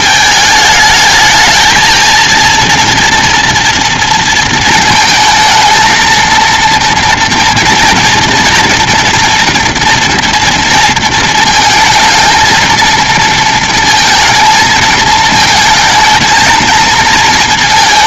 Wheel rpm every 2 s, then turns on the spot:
220, 230, 230, 230, 230, 230, 230, 220, 220.
none